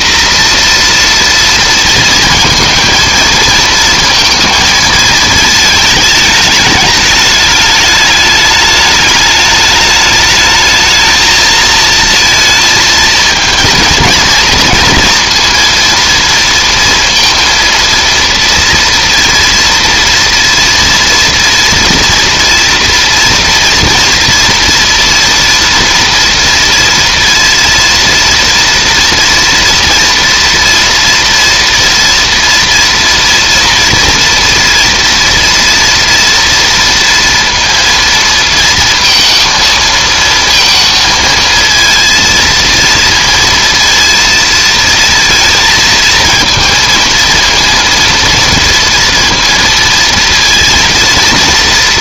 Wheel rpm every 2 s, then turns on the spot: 250, 230, 220, 210, 210, 220, 230, 230, 230, 230, 230, 230, 230, 230, 230, 230, 240, 230, 230, 230, 230, 230, 230, 230, 230, 230.
none